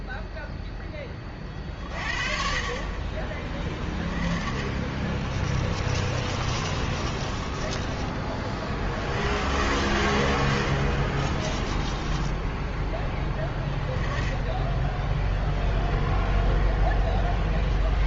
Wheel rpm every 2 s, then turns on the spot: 10, 30, 30, 30, 50, 50, 10, 10, 0.
4-8 10-12